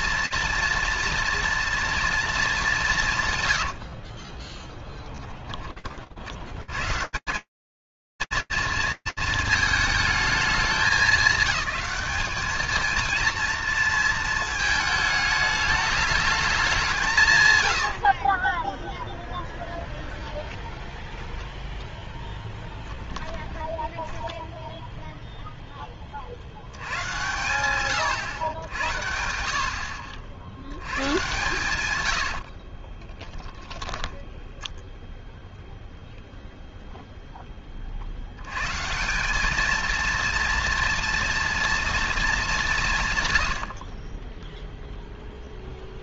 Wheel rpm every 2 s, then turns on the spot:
230, 150, 10, 190, 230, 210, 230, 220, 110, 10, 0, 0, 70, 110, 100, 50, 0, 0, 180, 240, 160, 0, 0.
16-18 30-32